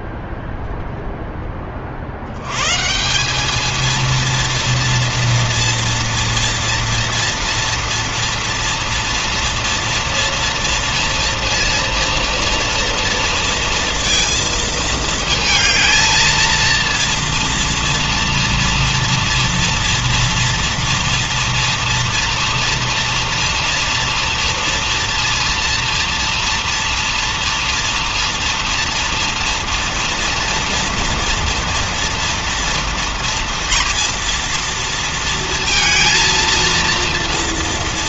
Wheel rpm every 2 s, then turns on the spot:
0, 180, 230, 230, 230, 230, 230, 220, 230, 230, 230, 230, 230, 230, 230, 230, 230, 230, 230.
none